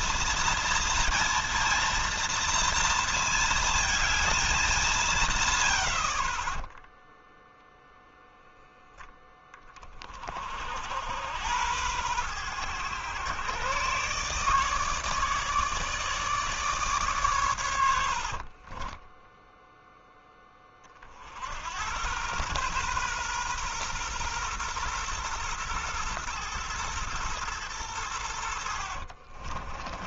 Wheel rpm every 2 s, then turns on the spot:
230, 230, 180, 10, 10, 70, 110, 150, 140, 20, 40, 120, 120, 120, 60.
18-20 28-30